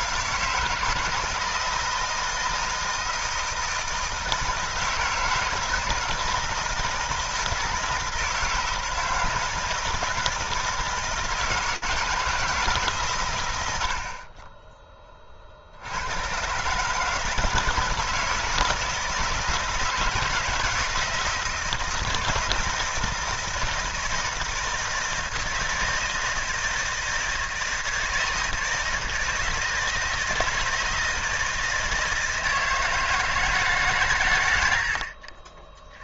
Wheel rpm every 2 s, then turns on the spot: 160, 160, 160, 160, 160, 160, 150, 20, 130, 160, 160, 160, 160, 160, 160, 160, 160, 100.
none